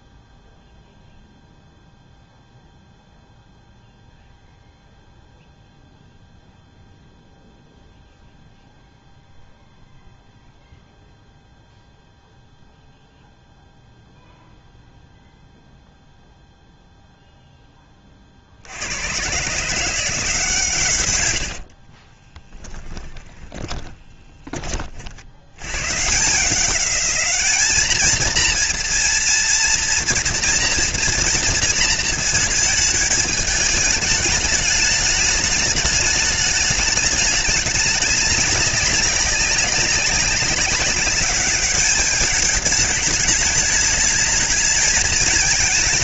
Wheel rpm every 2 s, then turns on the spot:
0, 0, 0, 0, 0, 0, 0, 0, 0, 90, 120, 20, 50, 200, 230, 240, 220, 210, 210, 200, 200, 210, 210.
22-24